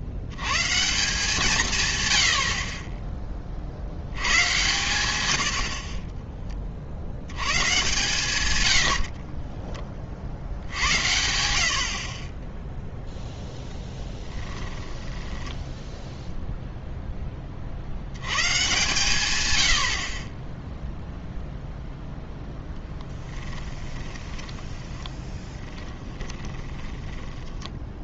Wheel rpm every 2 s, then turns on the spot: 130, 50, 120, 20, 100, 70, 10, 10, 0, 130, 10, 10, 10, 20.
14-16 24-28